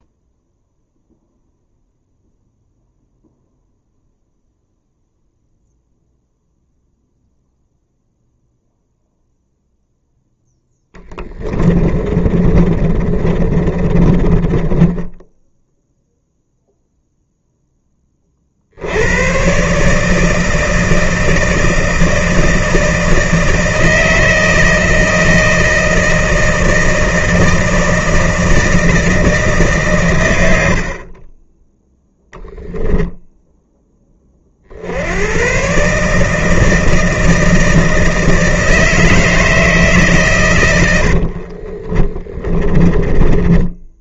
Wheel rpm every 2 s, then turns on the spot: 0, 0, 0, 0, 0, 10, 40, 20, 0, 80, 160, 160, 160, 160, 160, 50, 10, 70, 160, 160, 100, 20.
10-16 40-44